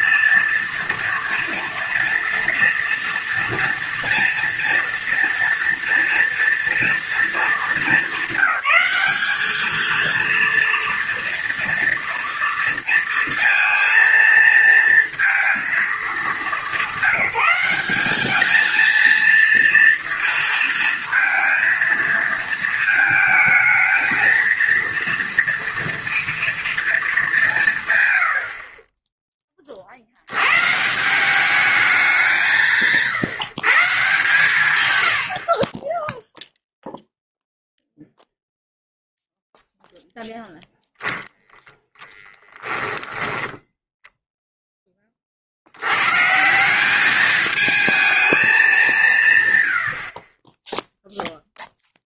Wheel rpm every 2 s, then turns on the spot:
230, 230, 230, 230, 200, 230, 230, 230, 200, 210, 230, 220, 230, 240, 60, 120, 160, 120, 0, 0, 0, 10, 0, 160, 210, 20.
none